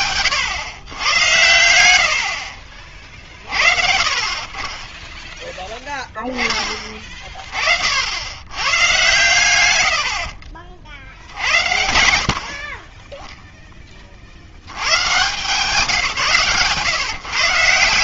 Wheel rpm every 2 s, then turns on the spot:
110, 40, 20, 20, 100, 60, 30, 120, 120.
8-10